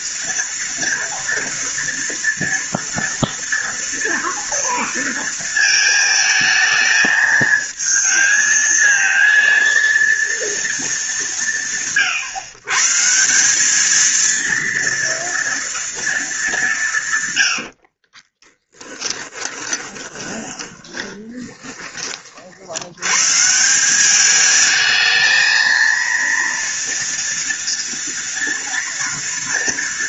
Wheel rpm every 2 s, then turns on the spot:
230, 240, 230, 220, 220, 210, 140, 230, 170, 10, 20, 80, 220, 230, 230.
18-22